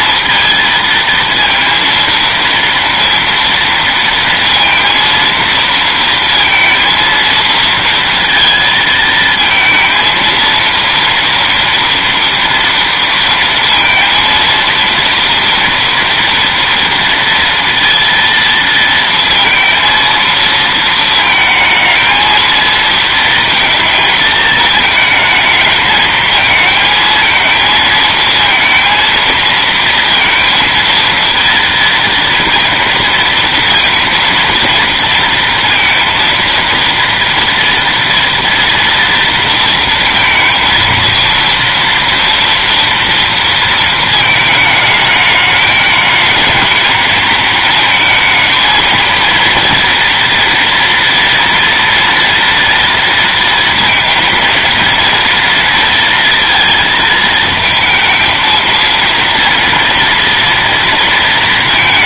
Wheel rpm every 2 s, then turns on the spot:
230, 230, 230, 230, 230, 230, 230, 230, 230, 230, 220, 220, 220, 230, 230, 230, 230, 230, 230, 230, 230, 220, 220, 220, 230, 230, 230, 230, 230, 240, 220.
none